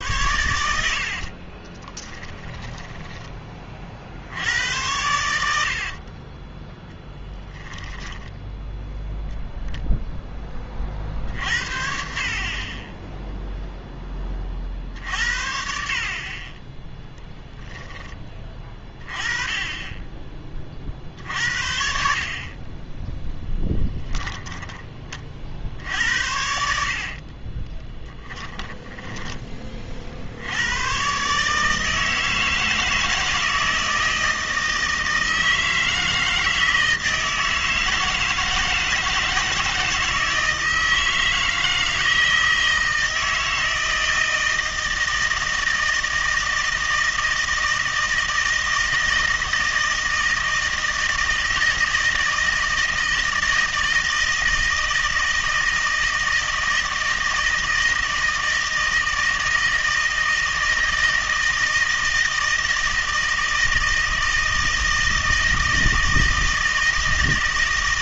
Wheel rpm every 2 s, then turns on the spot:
90, 10, 80, 10, 0, 30, 30, 40, 20, 20, 30, 40, 10, 70, 10, 90, 160, 160, 160, 160, 160, 160, 160, 160, 160, 160, 160, 160, 160, 160, 160, 160, 160, 160.
2-4 6-8 24-30